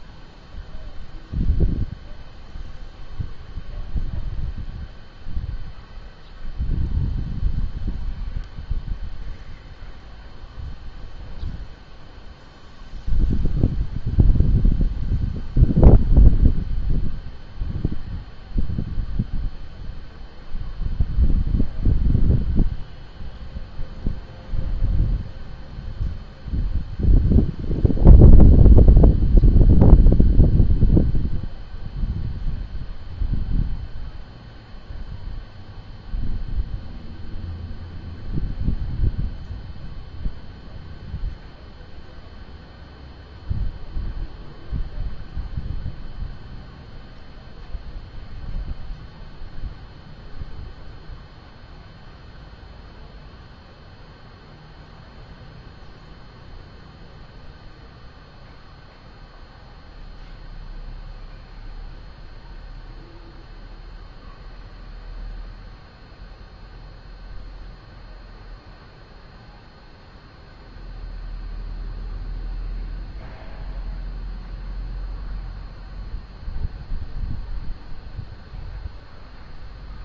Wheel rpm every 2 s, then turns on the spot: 0, 0, 0, 0, 0, 0, 0, 0, 0, 0, 0, 0, 0, 0, 0, 0, 0, 0, 0, 0, 0, 0, 0, 0, 0, 0, 0, 0, 0, 0, 0, 0, 0, 0, 0, 0, 0, 0, 0, 0.
none